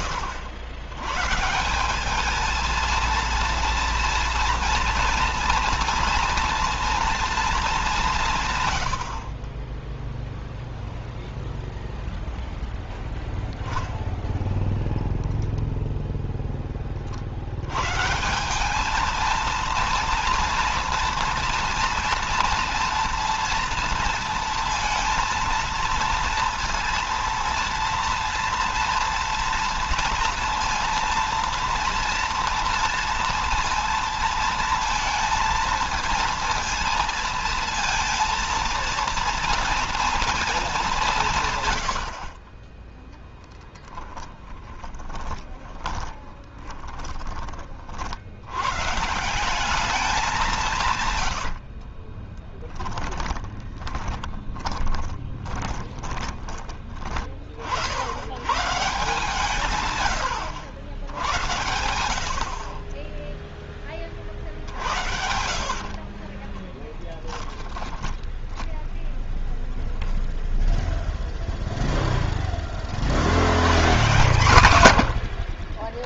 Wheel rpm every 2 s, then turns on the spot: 120, 230, 230, 230, 110, 0, 0, 0, 20, 200, 230, 230, 230, 230, 230, 230, 230, 230, 230, 230, 190, 10, 20, 10, 130, 160, 10, 20, 20, 140, 100, 40, 70, 30, 10, 0, 20, 120.
44-48 50-56 62-64 66-70